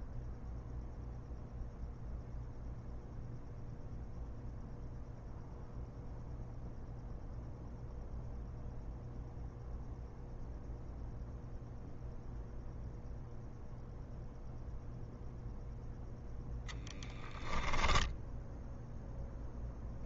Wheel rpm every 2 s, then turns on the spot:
0, 0, 0, 0, 0, 0, 0, 0, 10, 10.
16-18